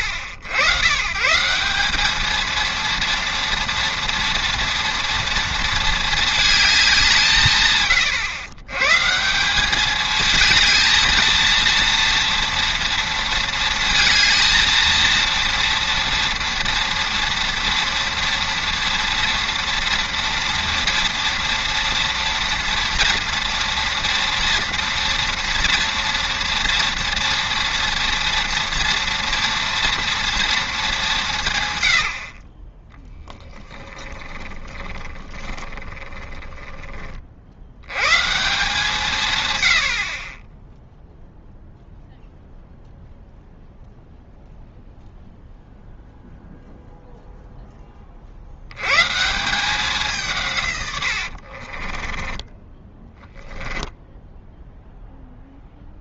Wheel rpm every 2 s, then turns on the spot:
90, 220, 230, 210, 120, 220, 230, 230, 230, 240, 230, 230, 230, 230, 230, 220, 30, 20, 20, 160, 10, 0, 0, 0, 90, 140, 10, 0.
34-38 52-54